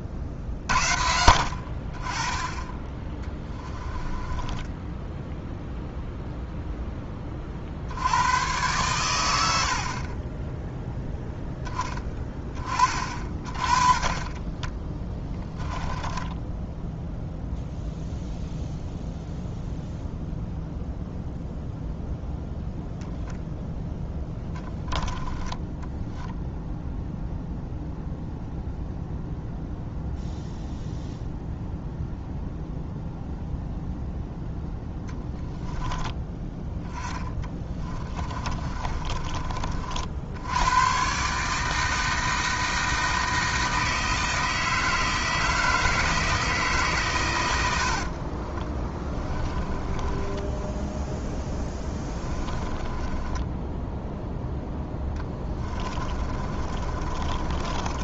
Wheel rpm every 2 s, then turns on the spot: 40, 20, 10, 0, 110, 10, 30, 20, 10, 0, 0, 0, 10, 0, 0, 0, 0, 10, 10, 30, 100, 160, 160, 150, 20, 10, 10, 10, 30.
4-6 14-18 36-40 48-54 56-58